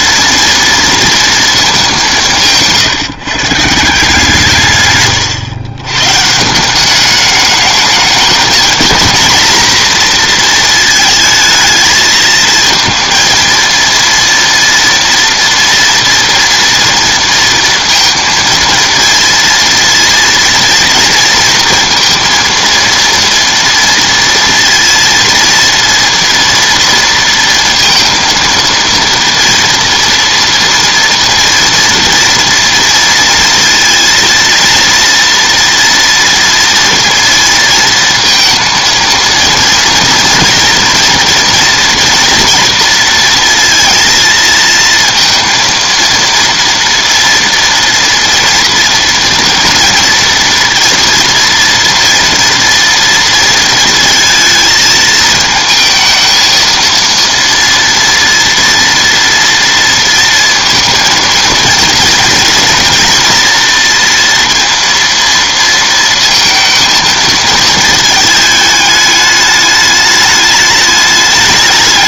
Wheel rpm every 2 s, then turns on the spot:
230, 160, 140, 180, 220, 230, 230, 230, 230, 230, 230, 230, 230, 230, 230, 240, 230, 230, 230, 230, 230, 230, 230, 230, 230, 230, 230, 220, 230, 230, 230, 230, 230, 220, 210, 210.
none